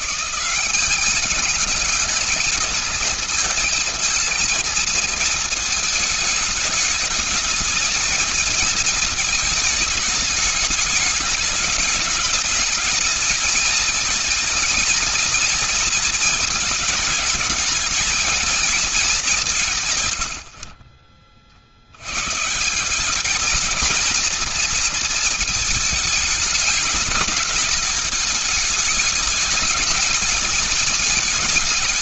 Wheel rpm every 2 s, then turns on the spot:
200, 220, 230, 220, 220, 210, 220, 230, 220, 200, 50, 180, 230, 210, 220, 220.
none